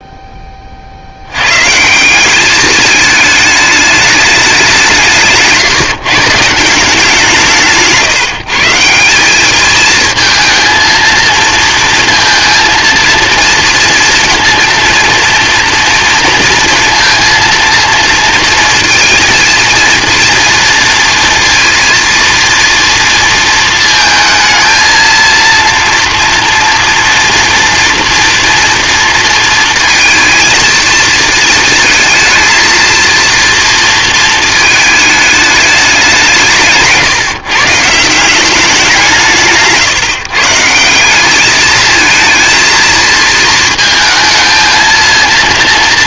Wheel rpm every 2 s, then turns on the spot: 30, 200, 190, 170, 170, 220, 230, 230, 230, 230, 230, 230, 220, 230, 240, 230, 220, 220, 160, 190, 160, 230, 220.
none